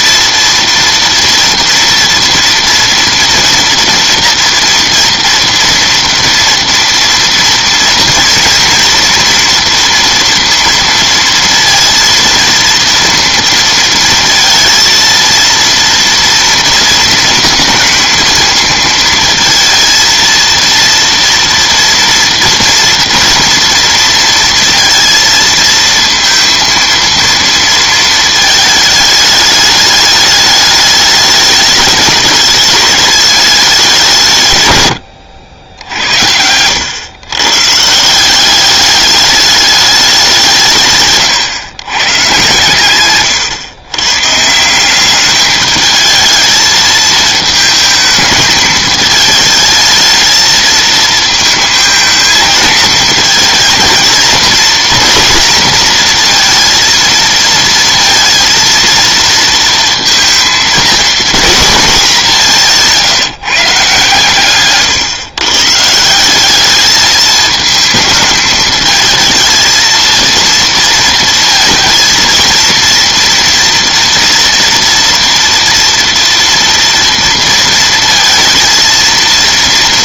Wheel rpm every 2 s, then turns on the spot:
230, 230, 230, 230, 230, 230, 230, 230, 230, 230, 230, 230, 230, 230, 220, 210, 210, 120, 100, 200, 150, 120, 170, 220, 210, 220, 220, 230, 230, 230, 230, 170, 130, 200, 220, 230, 230, 230, 230, 230.
36-38